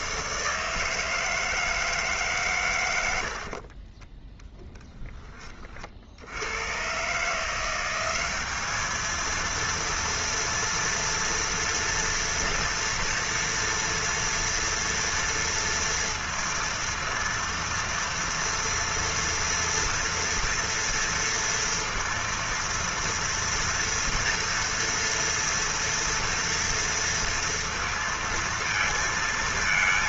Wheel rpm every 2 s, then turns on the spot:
160, 100, 10, 110, 210, 230, 230, 230, 230, 230, 230, 230, 230, 230, 230.
none